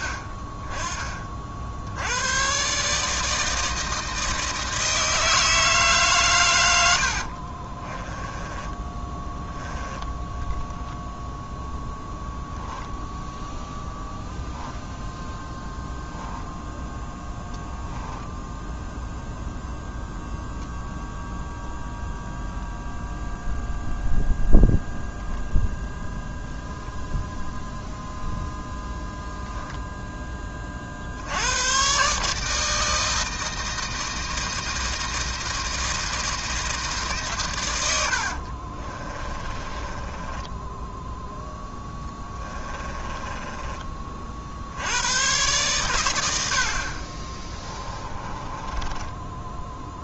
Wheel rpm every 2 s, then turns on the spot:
30, 140, 160, 90, 10, 0, 0, 0, 0, 0, 0, 0, 0, 0, 0, 40, 160, 160, 160, 40, 10, 20, 80, 50, 20.
8-10 38-44 48-50